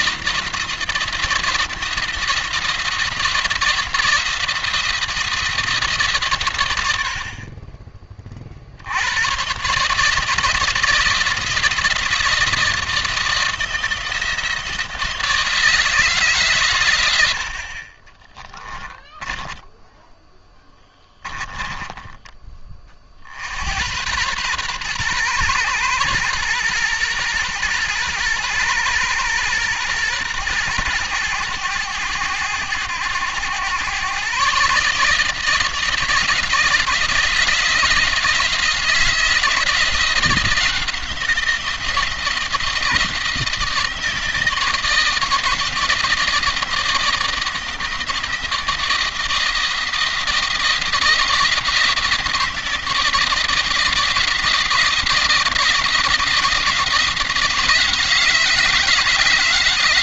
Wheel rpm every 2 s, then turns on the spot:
170, 160, 170, 80, 90, 160, 160, 170, 100, 10, 10, 40, 120, 120, 120, 110, 100, 150, 170, 160, 170, 170, 160, 160, 170, 170, 160, 170, 160, 160.
18-20